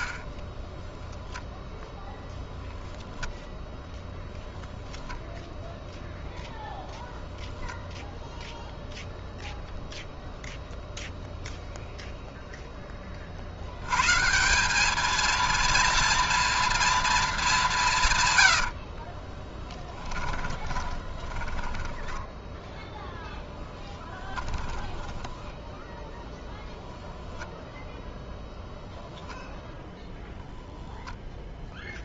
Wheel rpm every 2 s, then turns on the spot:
0, 0, 0, 0, 0, 0, 180, 230, 90, 20, 10, 10, 0, 0, 0, 0.
16-24